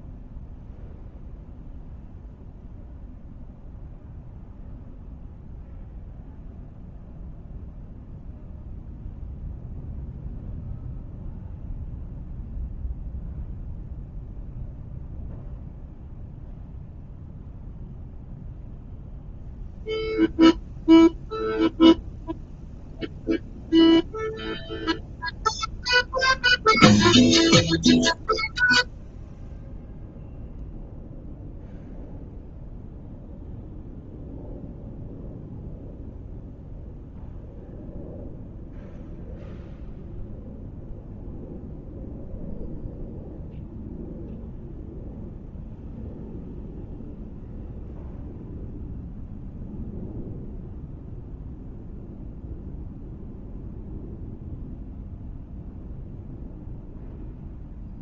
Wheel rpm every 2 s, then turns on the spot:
0, 0, 0, 0, 0, 0, 0, 0, 0, 0, 0, 0, 0, 0, 0, 0, 0, 0, 0, 0, 0, 0, 0, 0, 0, 0, 0, 0, 0.
none